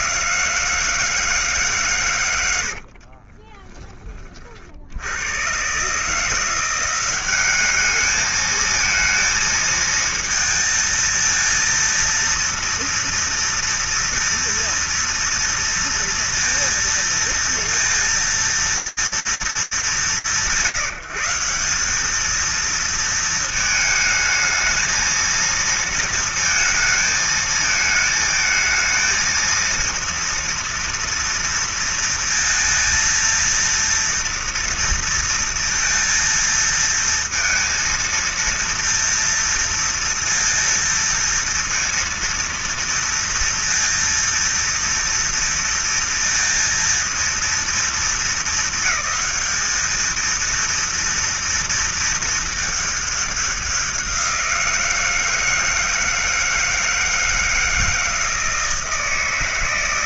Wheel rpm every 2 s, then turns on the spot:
180, 120, 20, 150, 210, 230, 230, 230, 230, 230, 180, 210, 220, 230, 220, 230, 230, 230, 220, 230, 230, 230, 230, 230, 220, 230, 220, 170, 160, 160.
none